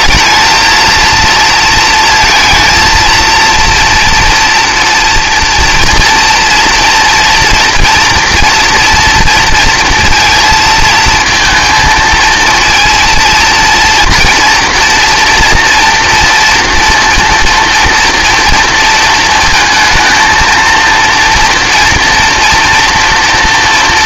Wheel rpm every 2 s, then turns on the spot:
220, 230, 240, 240, 230, 230, 230, 230, 230, 230, 230, 230.
none